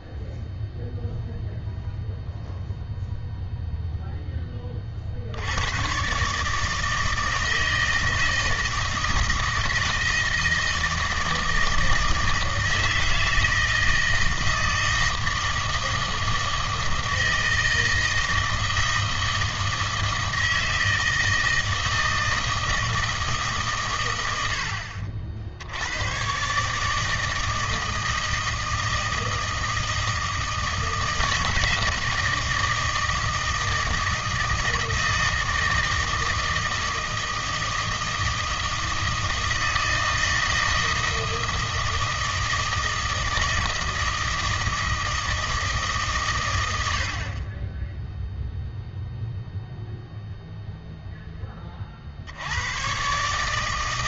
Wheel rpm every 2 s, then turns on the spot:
0, 0, 20, 150, 160, 160, 160, 160, 160, 160, 160, 160, 80, 140, 160, 160, 160, 160, 160, 160, 160, 160, 160, 100, 0, 0, 100.
none